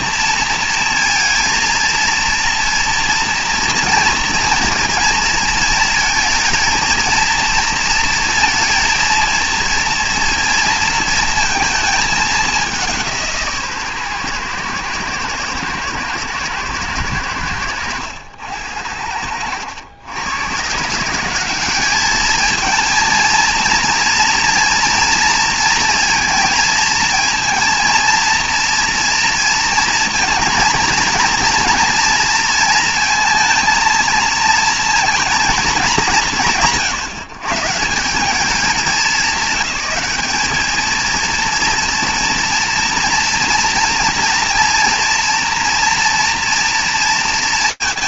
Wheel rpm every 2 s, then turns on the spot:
230, 230, 220, 220, 230, 230, 200, 120, 110, 80, 130, 220, 230, 220, 240, 220, 230, 230, 170, 200, 210, 230, 230, 230.
none